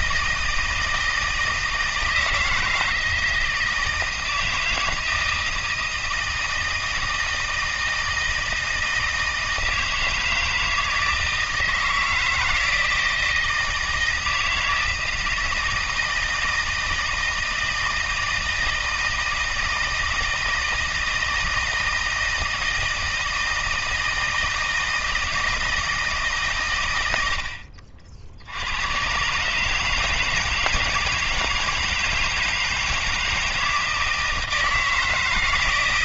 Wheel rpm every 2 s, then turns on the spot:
160, 160, 160, 160, 160, 160, 160, 160, 160, 160, 160, 160, 160, 110, 90, 160, 160, 160.
none